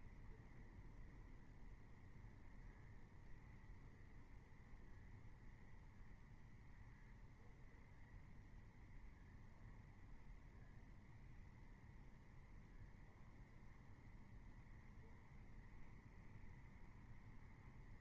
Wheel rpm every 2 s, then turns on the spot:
0, 0, 0, 0, 0, 0, 0, 0, 0.
none